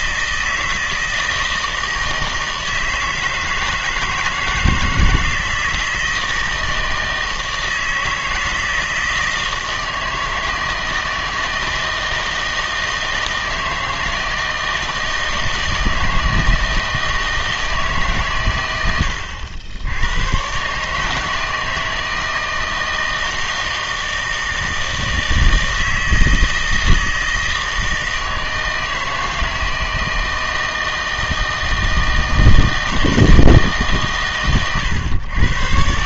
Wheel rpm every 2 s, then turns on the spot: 160, 160, 160, 160, 160, 160, 160, 160, 160, 100, 140, 160, 160, 160, 160, 160, 160, 110.
none